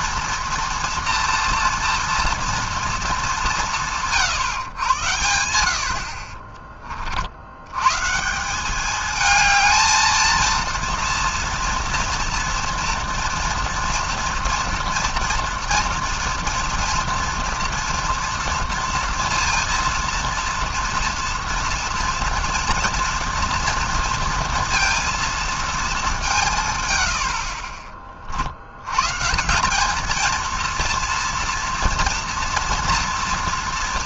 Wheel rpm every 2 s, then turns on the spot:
240, 230, 130, 20, 190, 230, 230, 240, 230, 230, 230, 230, 230, 150, 80, 230, 230.
6-8